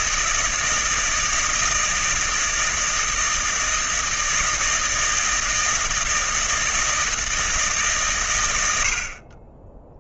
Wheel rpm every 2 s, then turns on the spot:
160, 160, 170, 160, 80.
none